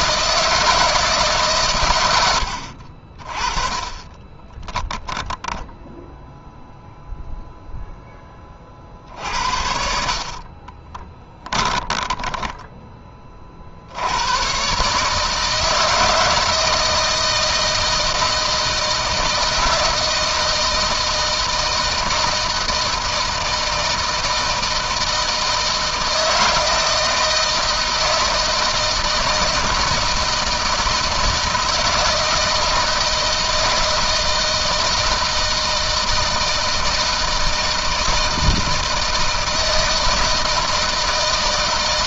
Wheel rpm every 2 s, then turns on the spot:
160, 60, 20, 0, 40, 30, 20, 120, 160, 160, 160, 160, 160, 160, 160, 160, 160, 160, 160, 160, 160.
4-6 10-14